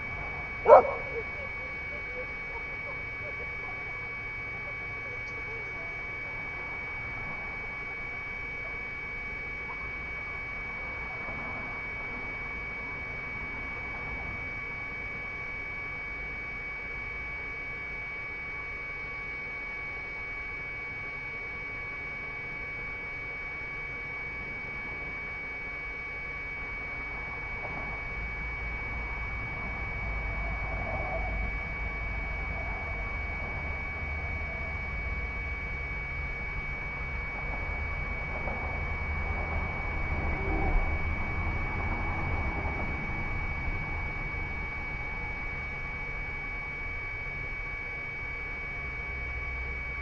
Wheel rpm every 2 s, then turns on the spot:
0, 0, 0, 0, 0, 0, 0, 0, 0, 0, 0, 0, 0, 0, 0, 0, 0, 0, 0, 0, 0, 0, 0, 0, 0.
none